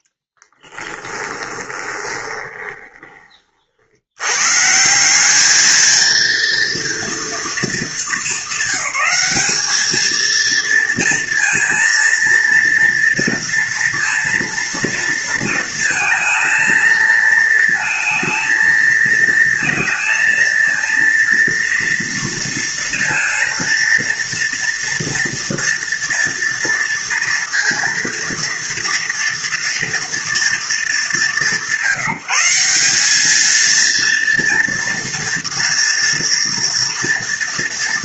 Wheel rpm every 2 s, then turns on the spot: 20, 30, 200, 230, 200, 230, 230, 230, 230, 230, 230, 230, 230, 230, 230, 180, 200, 230, 230.
0-2